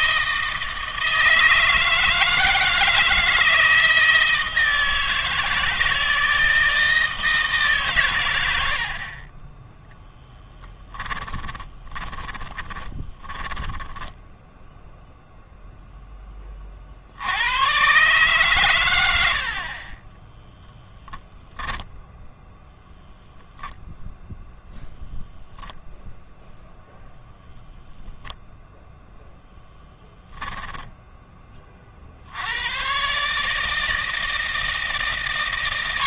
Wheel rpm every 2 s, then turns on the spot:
160, 160, 160, 160, 50, 10, 20, 0, 50, 90, 0, 0, 0, 0, 0, 10, 130, 150.
8-14